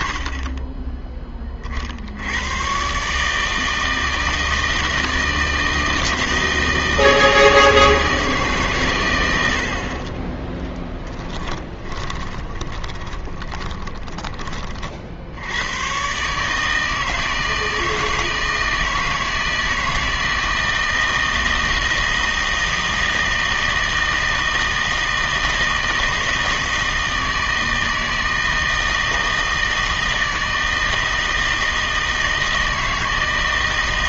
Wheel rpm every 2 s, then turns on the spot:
20, 120, 160, 160, 130, 20, 20, 40, 160, 160, 160, 160, 160, 160, 160, 160, 160.
10-14